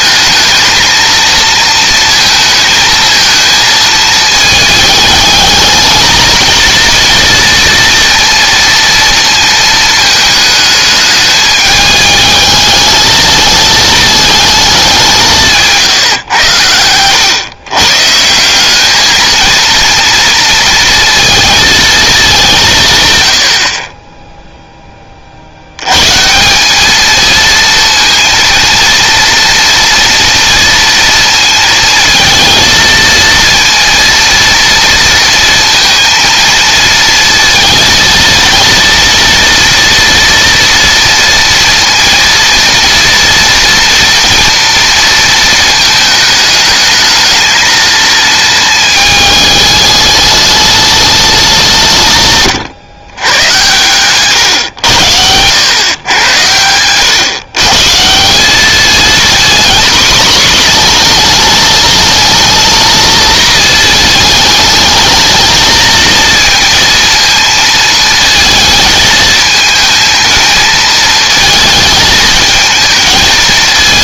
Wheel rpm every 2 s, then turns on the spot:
220, 220, 220, 230, 230, 220, 220, 210, 110, 180, 230, 180, 0, 170, 230, 230, 230, 230, 230, 230, 240, 230, 230, 210, 210, 210, 120, 120, 100, 200, 240, 220, 220, 230, 220, 220, 220.
54-56